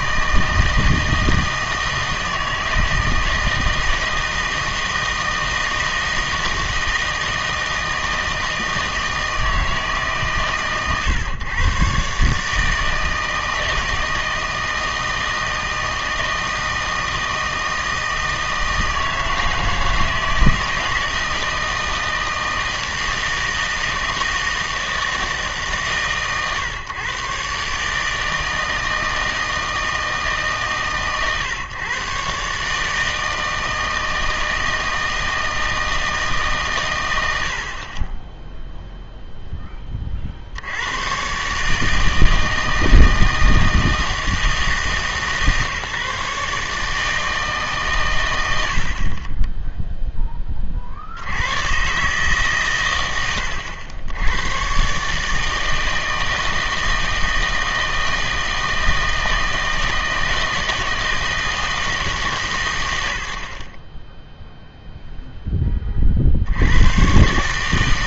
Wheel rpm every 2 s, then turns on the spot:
160, 160, 160, 160, 160, 140, 150, 160, 160, 160, 160, 160, 160, 130, 160, 140, 140, 160, 140, 0, 70, 160, 160, 150, 70, 30, 130, 120, 160, 160, 160, 130, 0, 80.
none